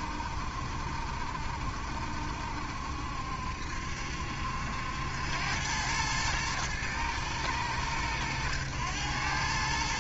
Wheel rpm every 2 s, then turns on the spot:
70, 70, 80, 110, 100.
none